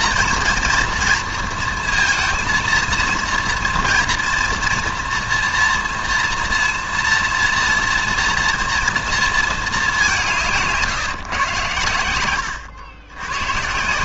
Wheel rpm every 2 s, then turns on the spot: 230, 230, 240, 230, 230, 160, 90.
none